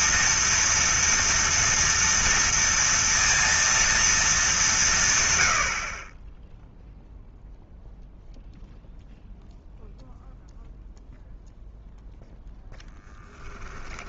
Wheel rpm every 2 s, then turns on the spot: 230, 230, 170, 0, 0, 0, 0.
none